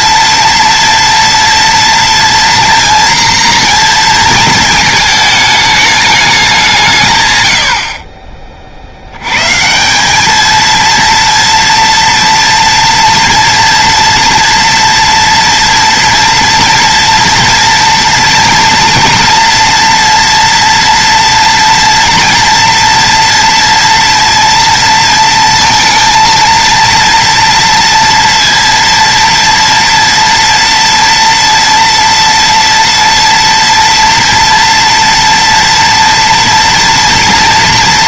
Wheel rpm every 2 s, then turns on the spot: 230, 240, 220, 180, 50, 230, 230, 240, 230, 230, 240, 230, 230, 230, 230, 230, 230, 230, 230.
none